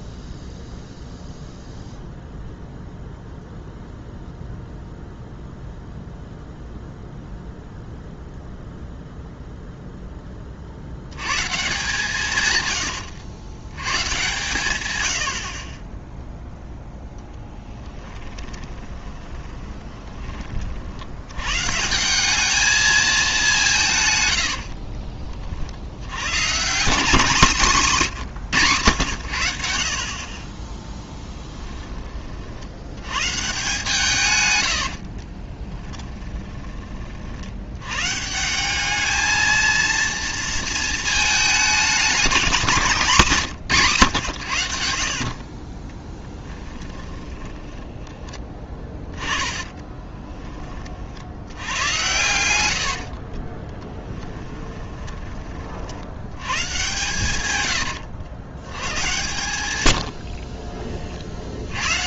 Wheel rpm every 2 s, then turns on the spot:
0, 0, 0, 0, 0, 30, 110, 120, 0, 20, 50, 210, 70, 170, 130, 20, 70, 90, 20, 190, 230, 190, 70, 10, 20, 20, 80, 10, 120, 100, 40.
18-20 24-26 34-36 46-50 52-56 60-62